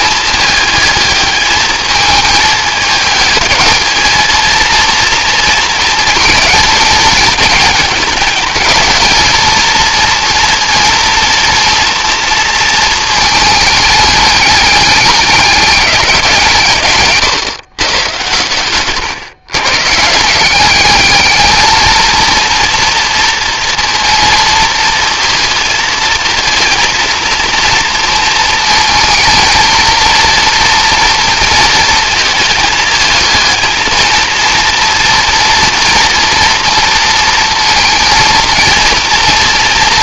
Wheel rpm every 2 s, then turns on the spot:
210, 210, 230, 220, 210, 230, 220, 210, 140, 120, 210, 230, 230, 230, 230, 230, 220, 230, 230, 230.
none